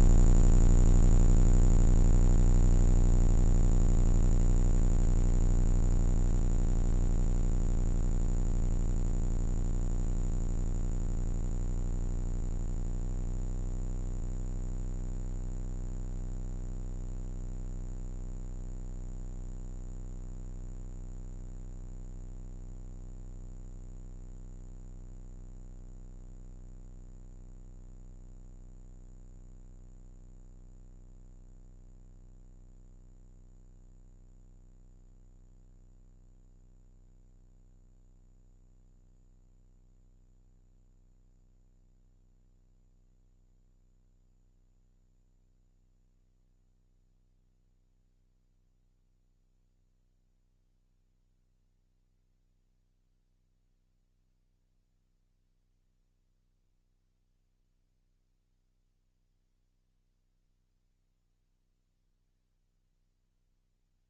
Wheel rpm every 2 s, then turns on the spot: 10, 20, 10, 10, 0, 0, 0, 0, 0, 0, 0, 0, 0, 0, 0, 0, 0, 0, 0, 0, 0, 0, 0, 0, 0, 0, 0, 0, 0, 0, 0, 0.
6-8